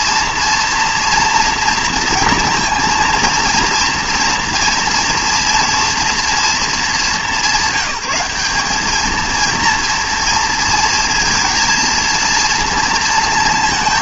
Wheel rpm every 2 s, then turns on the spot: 240, 230, 230, 220, 200, 230, 230.
none